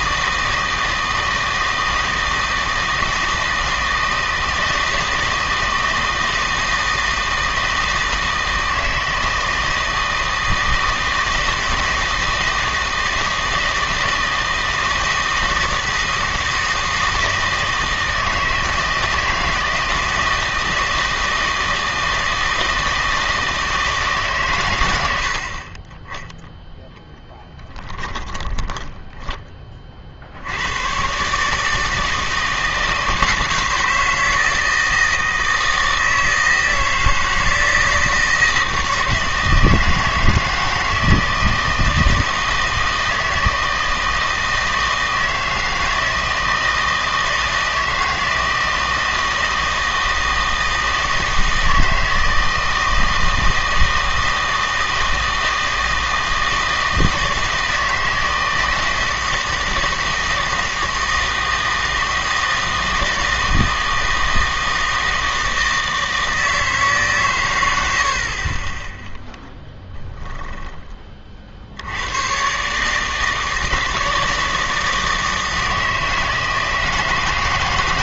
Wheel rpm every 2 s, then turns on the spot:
160, 160, 160, 160, 160, 160, 160, 160, 160, 160, 160, 160, 110, 0, 10, 100, 160, 160, 160, 160, 160, 160, 160, 160, 160, 160, 160, 160, 160, 160, 160, 160, 160, 160, 30, 20, 130, 160, 160.
28-30